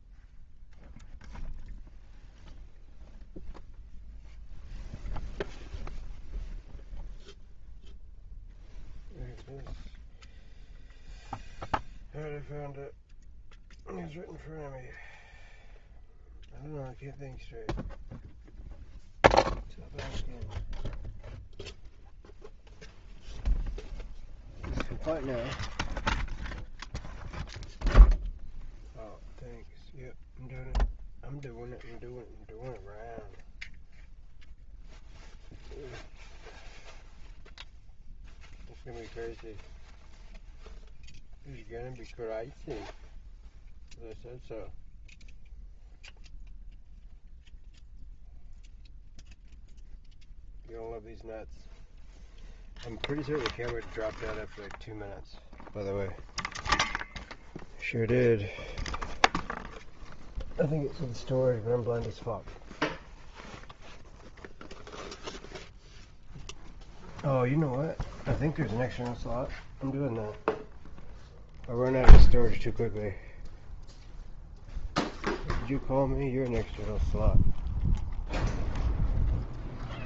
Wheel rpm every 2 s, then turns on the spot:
0, 0, 0, 0, 0, 0, 0, 0, 0, 0, 0, 0, 0, 0, 0, 0, 0, 0, 0, 0, 0, 0, 0, 0, 0, 0, 0, 0, 0, 0, 0, 0, 0, 0, 0, 0, 0, 0, 0, 0.
none